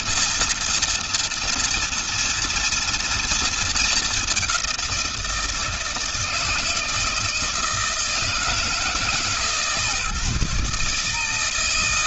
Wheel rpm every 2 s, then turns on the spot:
230, 230, 200, 160, 160, 150.
none